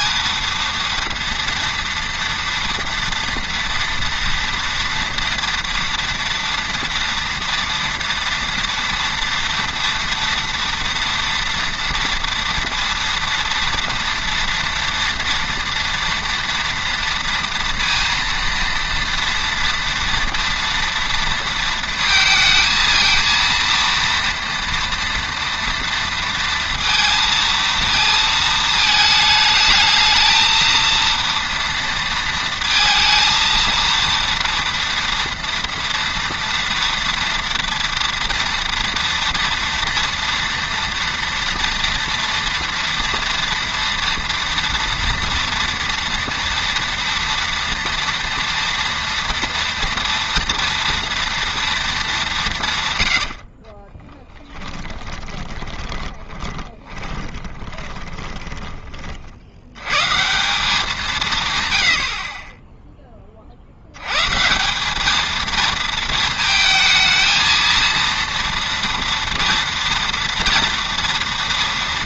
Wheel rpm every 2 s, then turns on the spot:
230, 240, 230, 230, 230, 230, 230, 230, 230, 230, 230, 230, 230, 230, 220, 220, 230, 230, 240, 230, 230, 230, 230, 230, 230, 230, 170, 10, 20, 20, 180, 30, 160, 220, 230, 230.
54-58